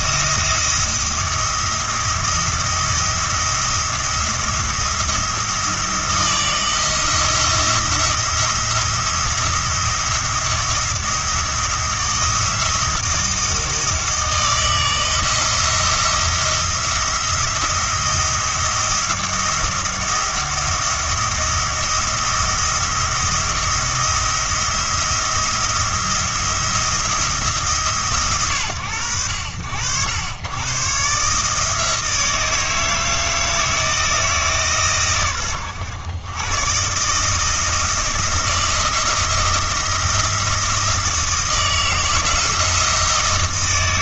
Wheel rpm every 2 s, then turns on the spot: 170, 170, 170, 170, 170, 170, 160, 160, 170, 170, 170, 170, 170, 170, 100, 120, 160, 140, 130, 170, 160, 160.
none